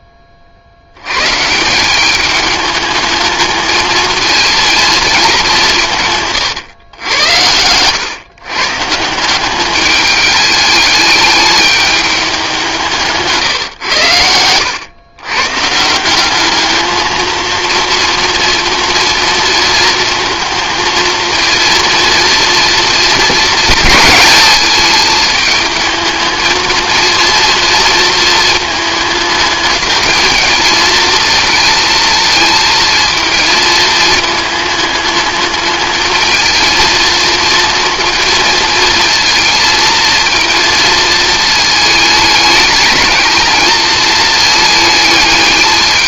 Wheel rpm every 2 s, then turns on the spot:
90, 210, 220, 100, 160, 210, 170, 110, 220, 230, 230, 230, 210, 230, 220, 220, 230, 220, 230, 230, 230, 210, 210.
none